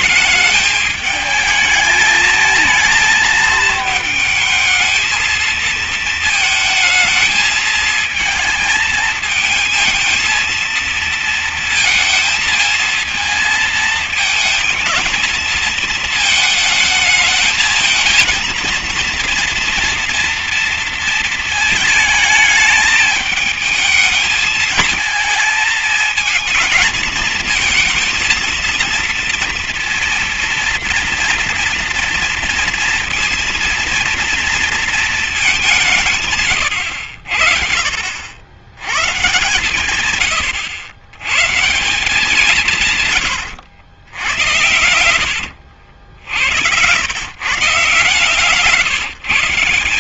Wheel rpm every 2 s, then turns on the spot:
220, 220, 220, 220, 220, 230, 220, 220, 220, 230, 230, 220, 220, 220, 230, 240, 230, 230, 120, 100, 110, 170, 80, 90, 140.
44-46